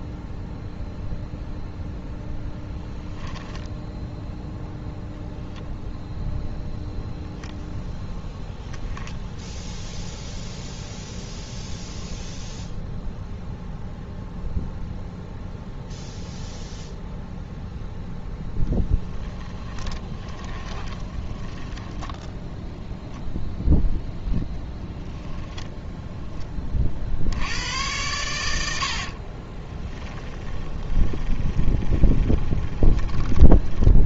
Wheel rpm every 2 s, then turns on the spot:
0, 0, 0, 0, 0, 0, 0, 0, 0, 20, 20, 10, 10, 30, 80, 20, 10.
20-22 30-34